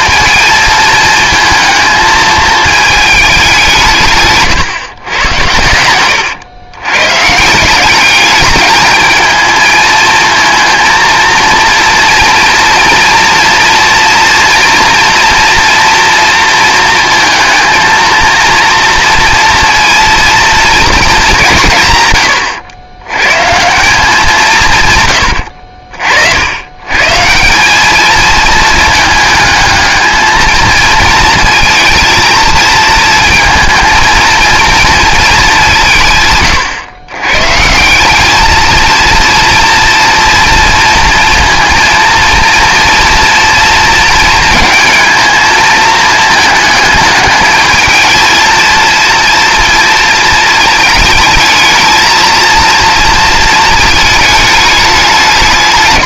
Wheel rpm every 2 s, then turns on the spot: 220, 220, 130, 120, 220, 230, 230, 230, 230, 230, 220, 100, 140, 100, 220, 220, 230, 230, 120, 220, 230, 230, 220, 210, 230, 220, 230, 210.
none